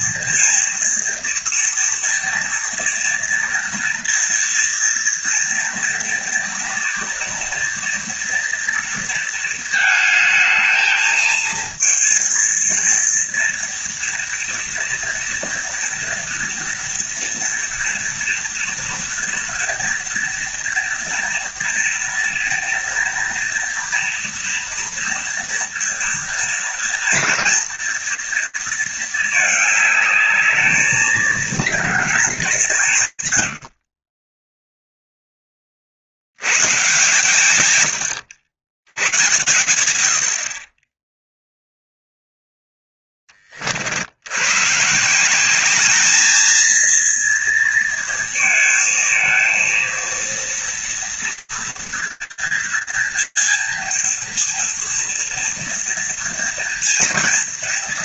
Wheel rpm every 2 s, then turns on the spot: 230, 230, 230, 230, 230, 220, 230, 230, 230, 230, 230, 230, 230, 230, 230, 210, 210, 10, 130, 110, 40, 10, 140, 230, 220, 230, 230, 230, 230.
none